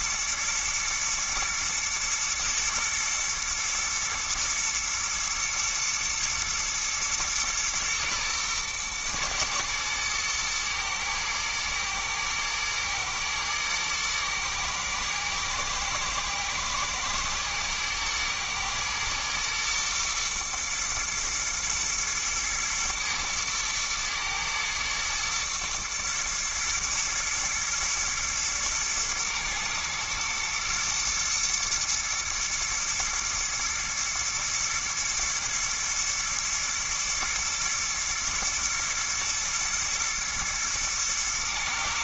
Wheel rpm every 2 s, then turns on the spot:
120, 120, 120, 110, 120, 110, 110, 110, 110, 120, 120, 110, 110, 110, 110, 120, 120, 110, 120, 120, 110.
none